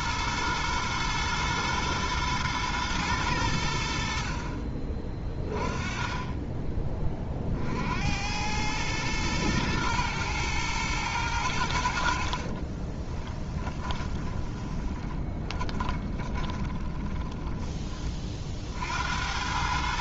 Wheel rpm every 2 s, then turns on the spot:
110, 110, 30, 20, 110, 120, 30, 20, 20, 70.
12-18